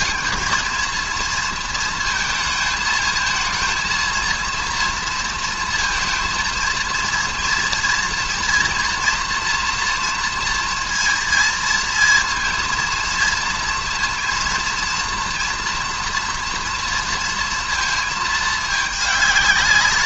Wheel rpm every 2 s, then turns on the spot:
230, 220, 230, 230, 240, 230, 230, 230, 240, 220.
none